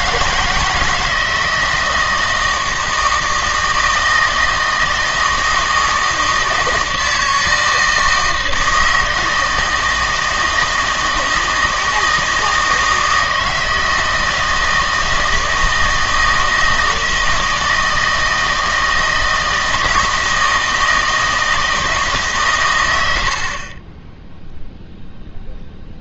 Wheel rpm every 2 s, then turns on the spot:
160, 160, 160, 160, 160, 160, 160, 160, 160, 160, 160, 100, 0.
none